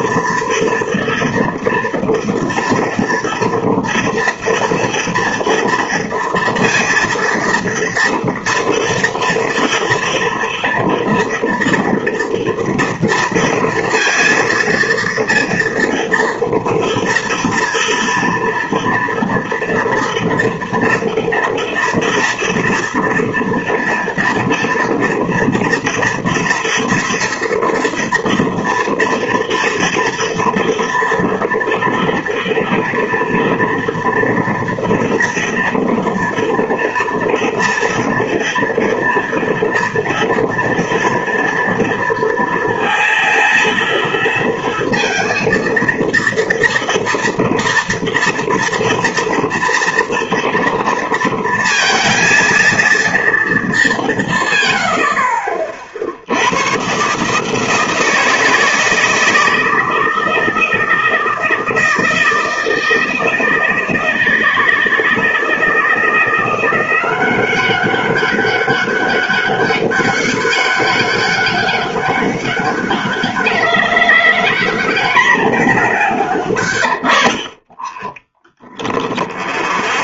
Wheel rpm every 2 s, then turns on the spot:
230, 230, 230, 230, 230, 230, 230, 230, 230, 230, 230, 230, 230, 230, 230, 230, 240, 230, 230, 230, 230, 230, 230, 230, 240, 230, 230, 90, 130, 160, 160, 160, 160, 180, 200, 200, 200, 220, 80, 0.
none